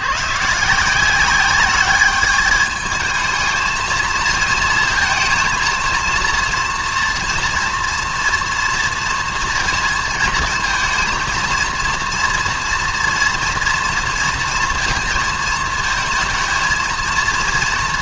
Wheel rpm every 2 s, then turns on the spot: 120, 210, 220, 230, 230, 230, 230, 230, 230.
none